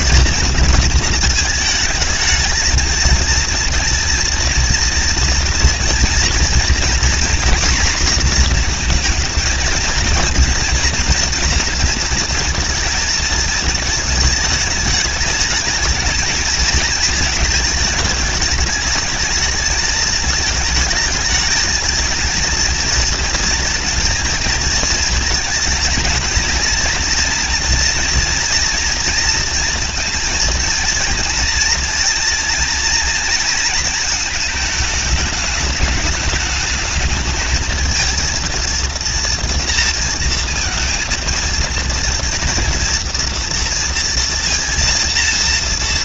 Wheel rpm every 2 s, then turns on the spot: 220, 220, 230, 230, 240, 230, 220, 220, 220, 210, 220, 220, 230, 230, 230, 230, 230, 220, 210, 230, 230, 230, 230.
none